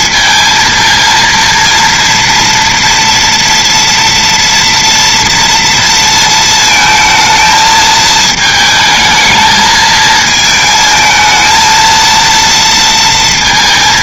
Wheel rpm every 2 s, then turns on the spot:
230, 230, 230, 220, 220, 220, 230.
none